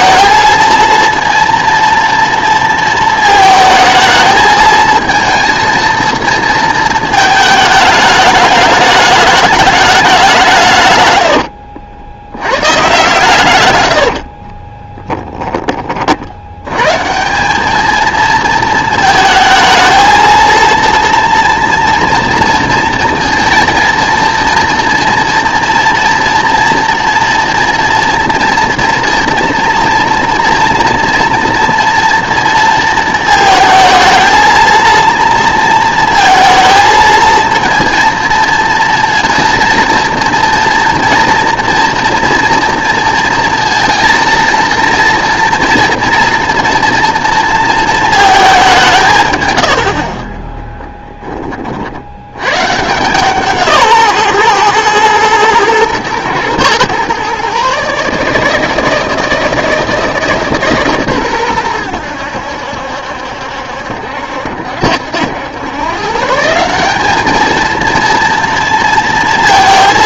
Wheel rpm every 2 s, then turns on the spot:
230, 230, 220, 220, 210, 150, 120, 20, 120, 220, 230, 230, 230, 240, 230, 240, 230, 230, 220, 230, 230, 230, 230, 240, 180, 10, 150, 120, 120, 160, 140, 70, 70, 190, 230.
14-16 50-52